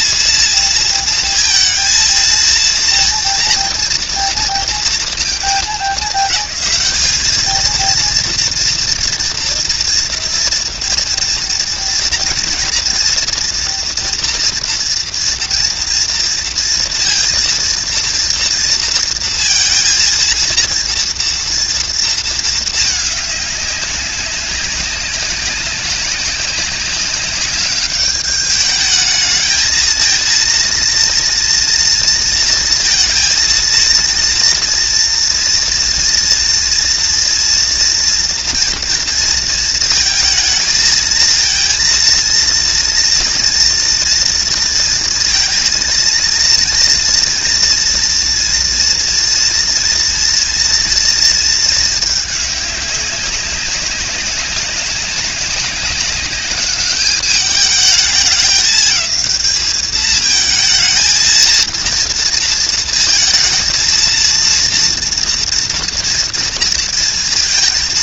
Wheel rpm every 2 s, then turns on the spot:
230, 230, 230, 210, 230, 230, 240, 230, 230, 230, 230, 220, 190, 200, 210, 230, 230, 230, 240, 230, 220, 230, 230, 230, 230, 230, 200, 190, 200, 210, 220, 230, 230, 230.
none